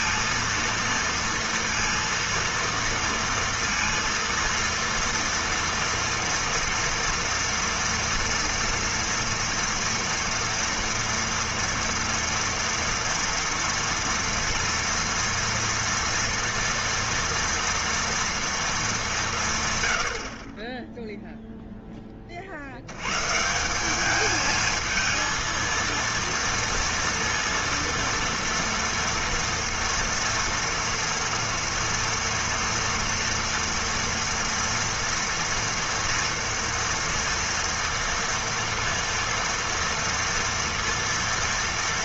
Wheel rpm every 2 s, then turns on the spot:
230, 230, 230, 230, 230, 230, 230, 230, 230, 230, 30, 60, 220, 230, 230, 230, 230, 230, 230, 230, 230.
none